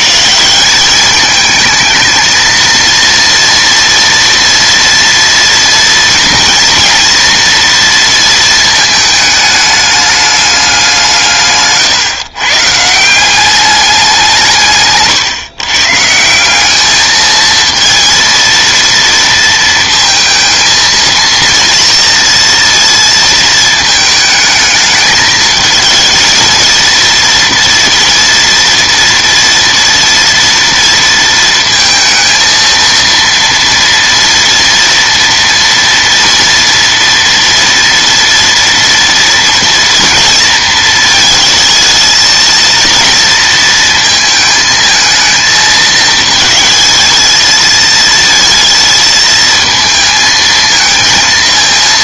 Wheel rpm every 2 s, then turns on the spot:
210, 230, 230, 230, 220, 180, 160, 140, 210, 230, 230, 230, 220, 230, 230, 230, 230, 230, 230, 230, 230, 230, 220, 220, 220, 230.
none